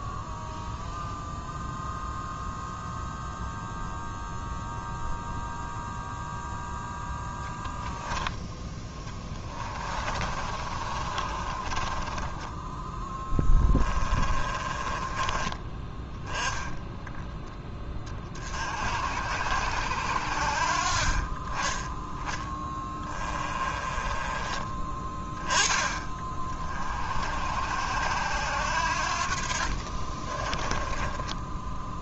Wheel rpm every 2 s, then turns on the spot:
0, 0, 0, 0, 10, 30, 10, 20, 10, 60, 50, 10, 20, 40, 70, 10.
8-12 14-16 22-24 30-32